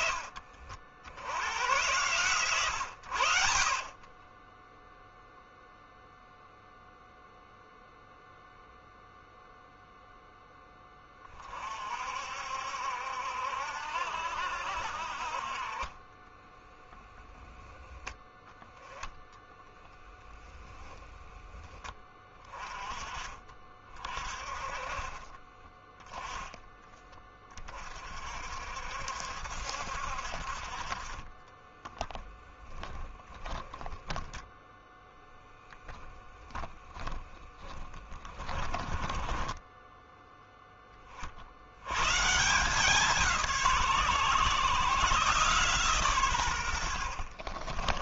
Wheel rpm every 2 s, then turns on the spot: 70, 110, 0, 0, 0, 10, 70, 60, 10, 10, 10, 30, 30, 20, 60, 40, 0, 0, 10, 20, 20, 170, 140, 70.
30-32 36-40 46-48